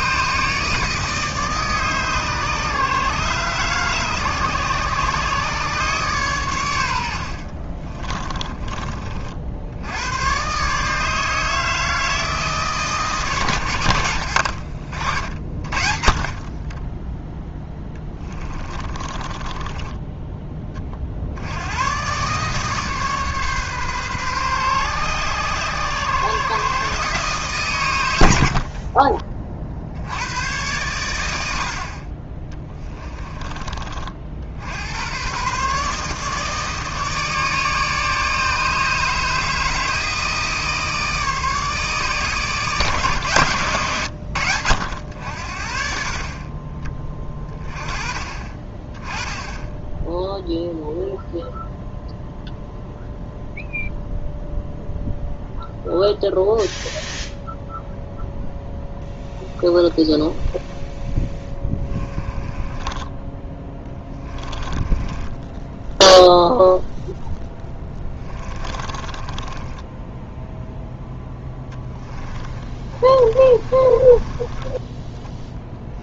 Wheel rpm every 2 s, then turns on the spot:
150, 150, 140, 100, 30, 140, 150, 70, 20, 20, 20, 140, 130, 130, 60, 110, 20, 80, 160, 150, 160, 150, 90, 30, 30, 0, 0, 0, 0, 0, 0, 20, 20, 0, 20, 0, 20, 10.
18-20 28-30 32-34 62-66 68-70 72-76